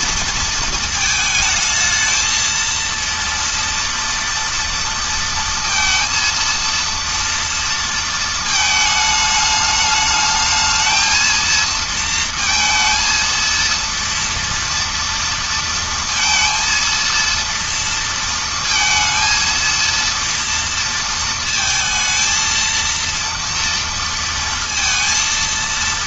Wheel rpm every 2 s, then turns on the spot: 220, 230, 230, 230, 220, 220, 230, 230, 230, 230, 230, 230, 230.
none